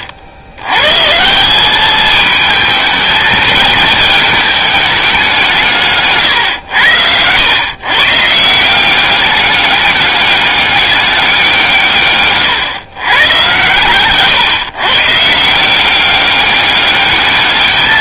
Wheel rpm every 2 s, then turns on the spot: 130, 220, 210, 100, 180, 200, 120, 130, 200.
none